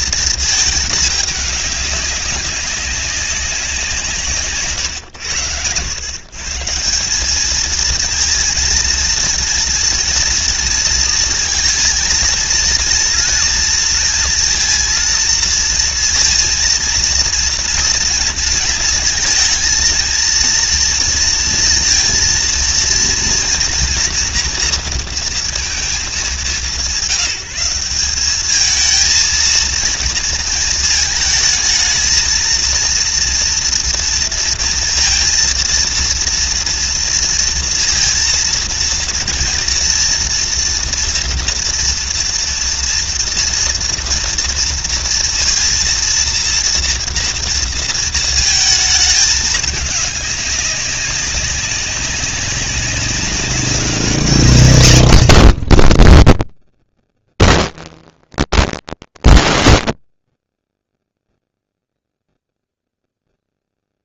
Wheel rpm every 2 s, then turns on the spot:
220, 200, 150, 140, 230, 230, 230, 230, 230, 230, 230, 230, 230, 180, 200, 220, 230, 230, 230, 230, 230, 230, 230, 230, 220, 200, 190, 170, 30, 260, 30, 0.
none